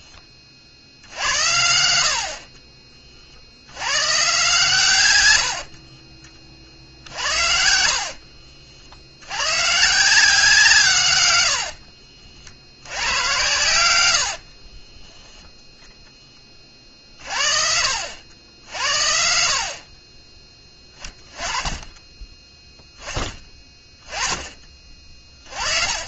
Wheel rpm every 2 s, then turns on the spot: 70, 40, 130, 50, 70, 140, 90, 30, 50, 80, 20, 10, 20.
14-16